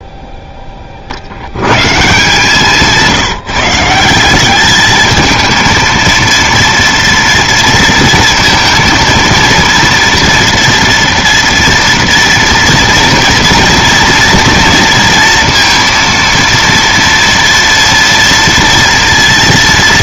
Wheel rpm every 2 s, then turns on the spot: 20, 160, 210, 240, 230, 230, 230, 230, 230, 230.
2-4